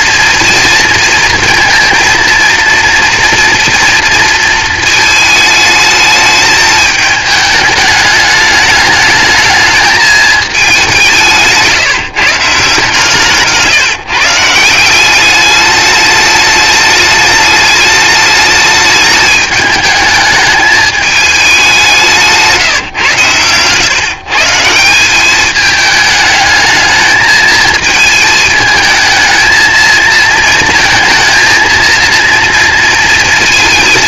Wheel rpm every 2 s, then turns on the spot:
230, 230, 220, 210, 210, 200, 150, 170, 210, 210, 210, 150, 170, 220, 220, 230, 230.
none